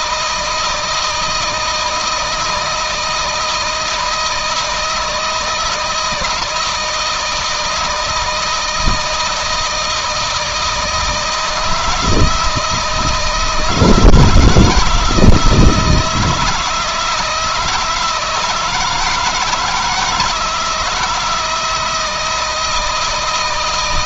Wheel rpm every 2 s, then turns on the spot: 160, 160, 160, 160, 160, 160, 160, 160, 170, 160, 160, 160.
none